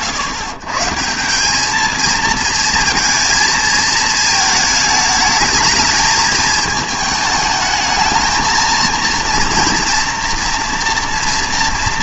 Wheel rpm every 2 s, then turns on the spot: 110, 230, 220, 220, 230, 240.
none